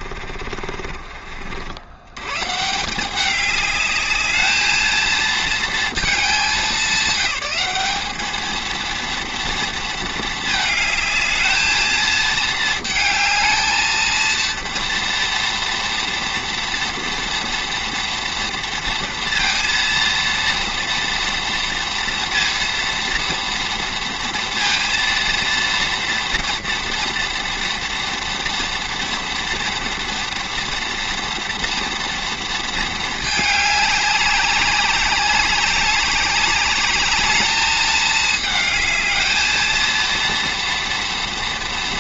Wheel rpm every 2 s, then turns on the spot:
40, 150, 220, 210, 220, 220, 230, 230, 230, 230, 230, 230, 230, 230, 230, 230, 230, 190, 200, 220, 230.
0-2